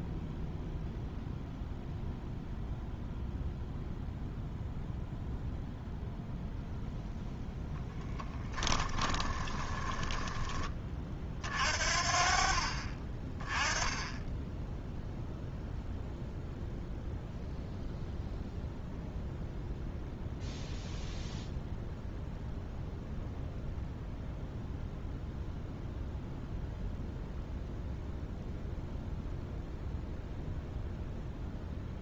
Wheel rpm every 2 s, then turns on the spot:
0, 0, 0, 0, 10, 20, 40, 0, 0, 0, 0, 0, 0, 0, 0, 0.
8-10